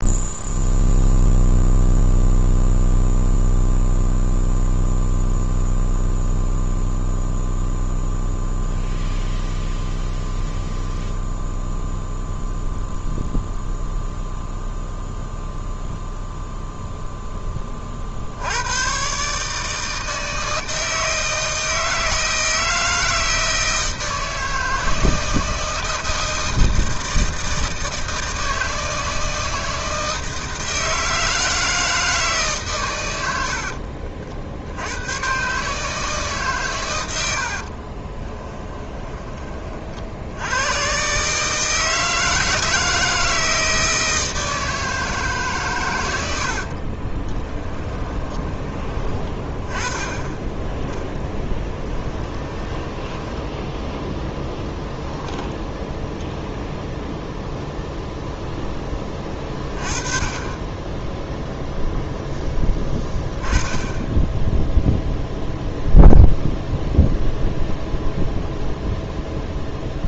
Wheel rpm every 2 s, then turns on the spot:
0, 0, 0, 0, 0, 0, 0, 0, 0, 100, 160, 160, 160, 160, 160, 160, 140, 70, 130, 20, 110, 160, 160, 60, 20, 10, 10, 0, 0, 0, 10, 10, 0, 0, 0.
38-40 46-48 52-54